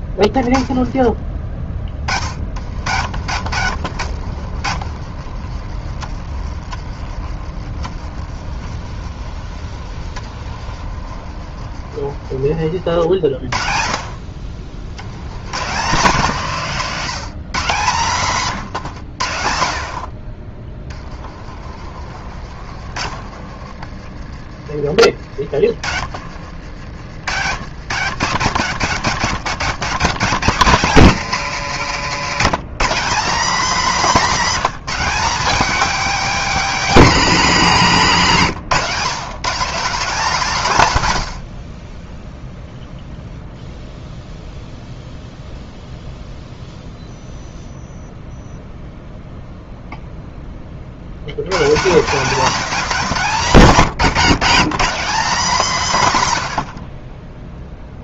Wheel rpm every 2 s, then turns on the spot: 10, 60, 50, 40, 40, 40, 50, 60, 170, 140, 30, 50, 30, 60, 140, 160, 170, 220, 230, 140, 150, 0, 0, 0, 0, 20, 160, 200, 70.
2-12 18-24 26-28